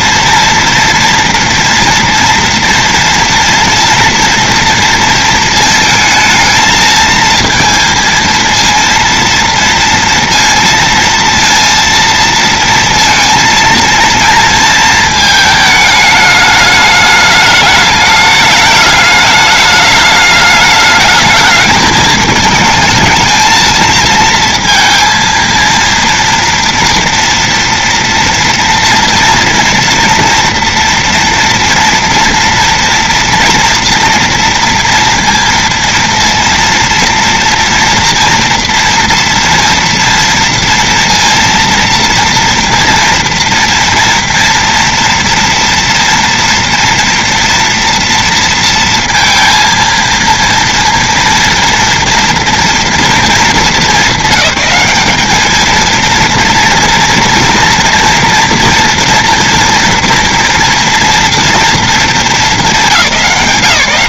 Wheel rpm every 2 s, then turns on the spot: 230, 230, 230, 220, 230, 230, 230, 230, 220, 210, 210, 220, 230, 230, 230, 230, 230, 230, 230, 230, 230, 230, 230, 230, 230, 230, 230, 200, 230, 230, 230, 230.
none